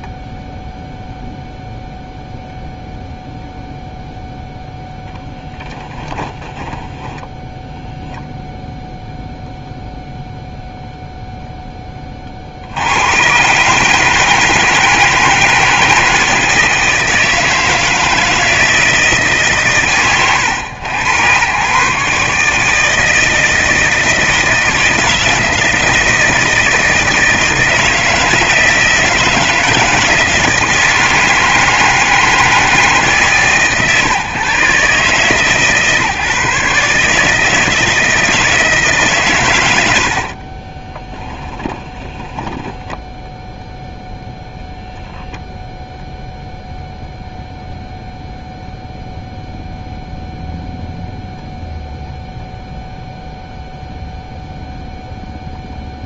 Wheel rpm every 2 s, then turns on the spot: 0, 0, 0, 10, 0, 0, 50, 160, 160, 160, 100, 150, 160, 160, 160, 160, 150, 140, 150, 160, 30, 10, 0, 0, 0, 0, 0, 0.
6-8 40-44